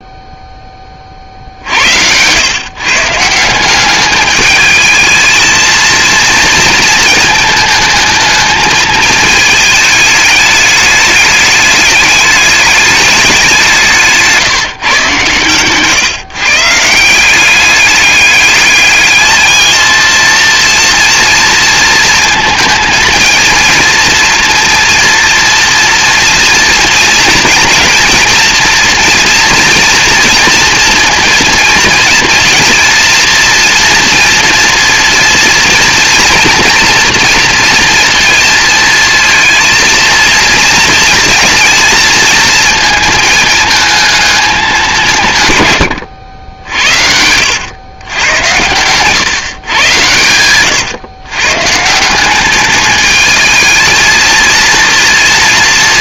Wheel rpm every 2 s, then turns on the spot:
20, 140, 220, 220, 220, 210, 200, 140, 170, 210, 230, 230, 230, 230, 230, 230, 230, 240, 240, 230, 230, 220, 180, 80, 120, 120, 210, 230.
46-48